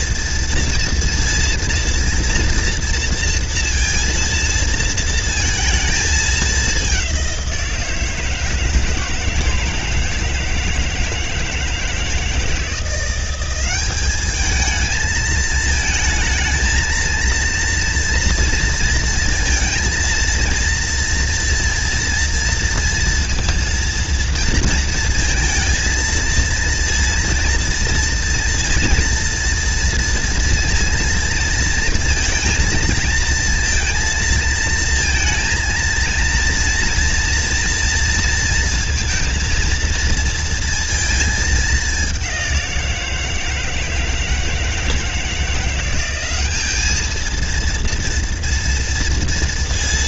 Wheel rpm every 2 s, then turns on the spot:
230, 230, 230, 200, 160, 160, 170, 220, 230, 230, 230, 230, 230, 230, 240, 230, 230, 230, 230, 230, 230, 170, 160, 220, 230.
none